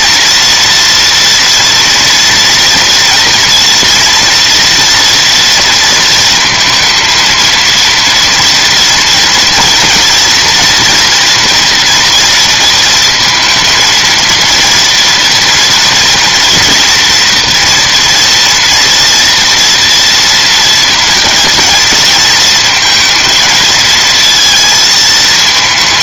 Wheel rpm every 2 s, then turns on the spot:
230, 230, 230, 230, 230, 240, 230, 230, 240, 240, 230, 220, 220.
none